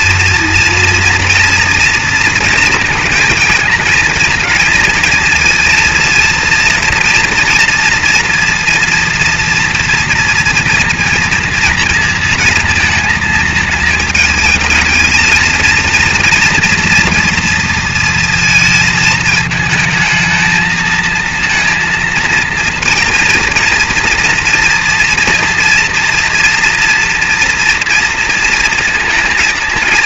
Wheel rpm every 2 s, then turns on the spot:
230, 230, 220, 230, 230, 230, 230, 220, 230, 220, 220, 220, 230, 230, 230.
none